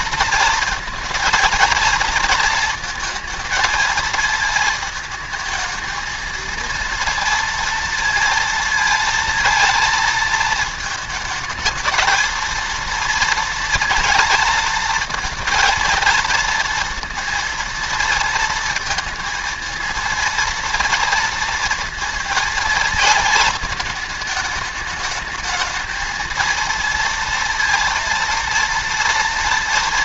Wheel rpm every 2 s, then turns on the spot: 230, 230, 220, 230, 230, 220, 230, 230, 230, 230, 230, 230, 210, 230, 230.
none